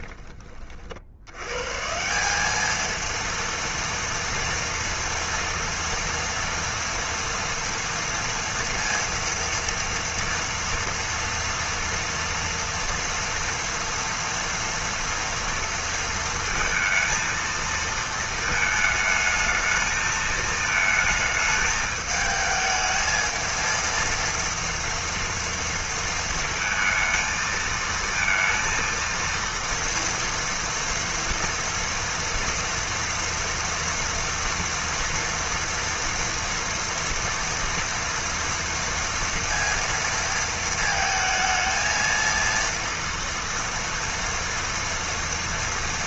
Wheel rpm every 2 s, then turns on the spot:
40, 210, 230, 230, 230, 230, 230, 230, 230, 220, 220, 220, 230, 230, 230, 230, 230, 230, 230, 230, 220, 230, 230.
none